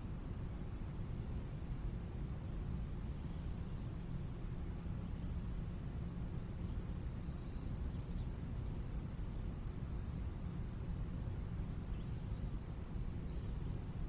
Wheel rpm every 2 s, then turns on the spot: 0, 0, 0, 0, 0, 0, 0.
none